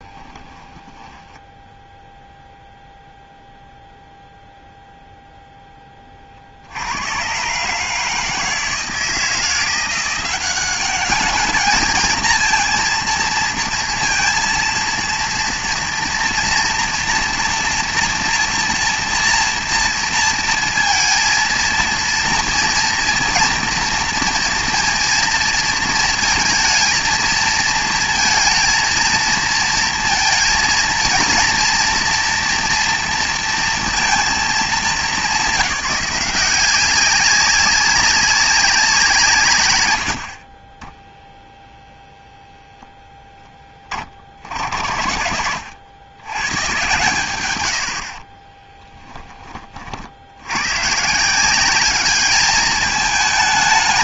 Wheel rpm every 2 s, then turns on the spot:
20, 0, 0, 70, 160, 200, 230, 230, 230, 240, 230, 230, 230, 220, 230, 230, 240, 220, 190, 190, 30, 0, 50, 110, 20, 110, 210.
0-2 48-50